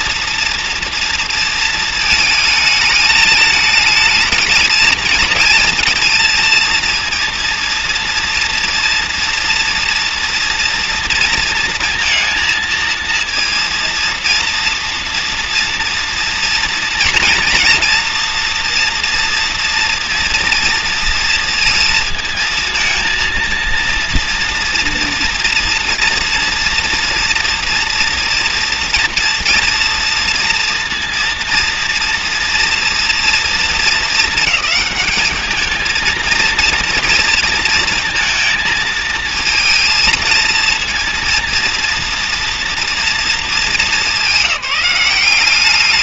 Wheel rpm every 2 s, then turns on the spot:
230, 220, 220, 230, 230, 240, 230, 230, 230, 240, 230, 230, 230, 230, 230, 230, 230, 220, 230, 230, 230, 240, 190.
none